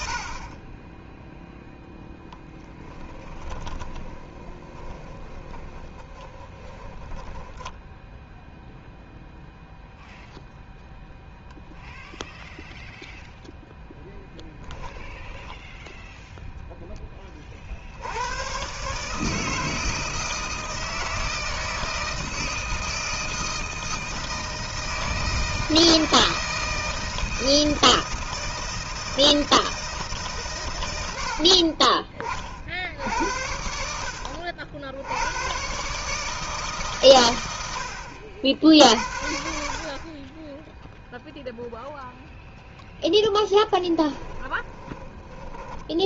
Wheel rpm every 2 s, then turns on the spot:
20, 10, 20, 20, 0, 0, 0, 10, 10, 130, 160, 160, 160, 160, 160, 120, 60, 80, 150, 60, 10, 0, 20.
2-8 44-46